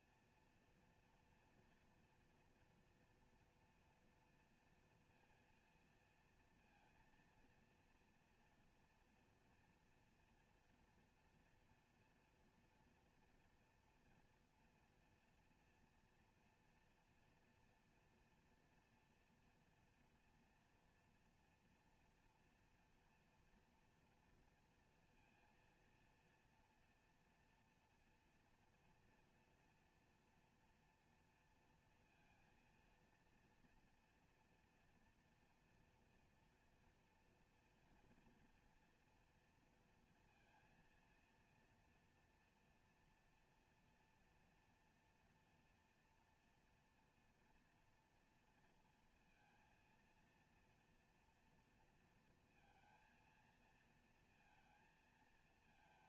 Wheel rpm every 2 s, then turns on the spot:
230, 230, 230, 230, 230, 240, 230, 230, 240, 230, 230, 230, 230, 240, 240, 230, 230, 230, 240, 230, 230, 230, 230, 230, 230, 230, 220, 230.
none